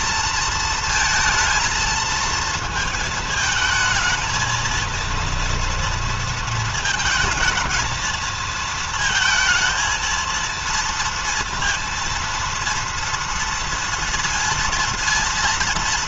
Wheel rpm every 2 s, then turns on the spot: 230, 220, 230, 220, 220, 230, 230, 230.
none